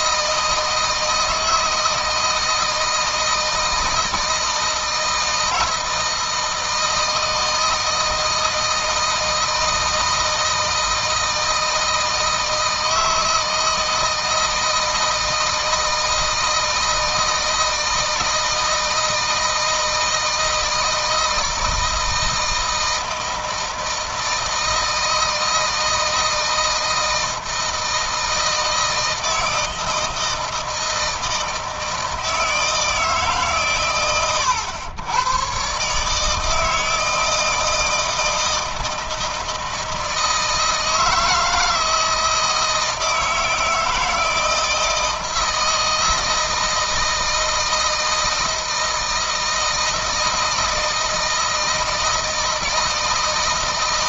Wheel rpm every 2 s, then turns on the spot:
160, 160, 160, 160, 160, 160, 160, 160, 160, 160, 160, 160, 160, 160, 160, 160, 160, 90, 160, 160, 160, 160, 160, 160, 160, 160, 160.
none